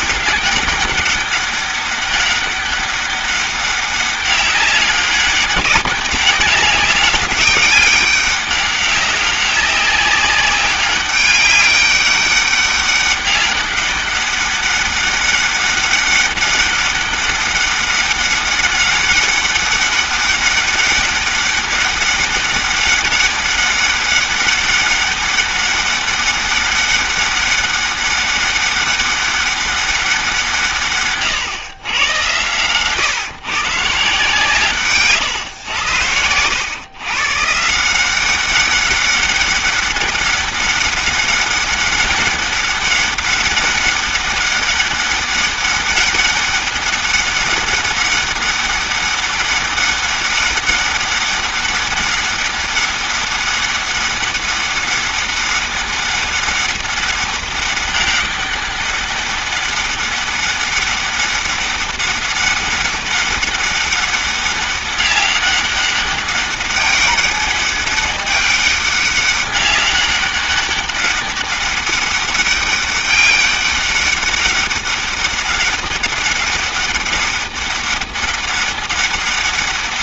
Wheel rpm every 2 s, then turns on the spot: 200, 200, 200, 200, 200, 200, 200, 200, 200, 200, 200, 200, 200, 200, 200, 120, 130, 140, 130, 200, 200, 200, 200, 200, 200, 200, 200, 200, 200, 200, 200, 200, 200, 200, 200, 200, 200, 200, 200, 200.
none